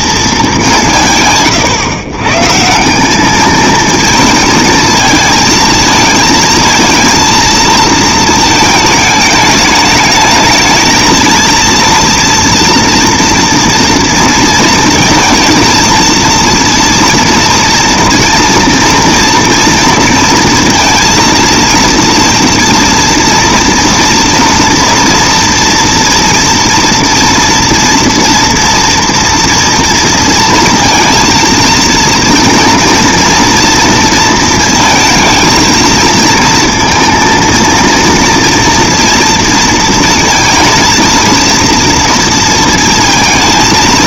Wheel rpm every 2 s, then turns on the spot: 120, 220, 220, 220, 220, 230, 230, 230, 240, 230, 230, 230, 230, 230, 230, 230, 230, 230, 230, 230, 230, 230.
none